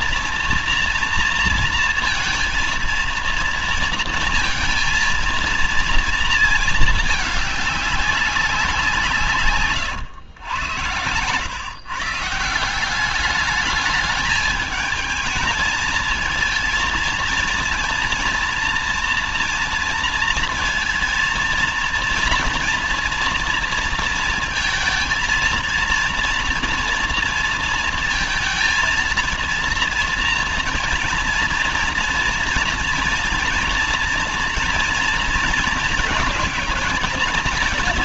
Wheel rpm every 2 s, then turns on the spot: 240, 230, 230, 230, 190, 110, 170, 210, 230, 230, 230, 240, 230, 230, 230, 230, 230, 240, 230.
none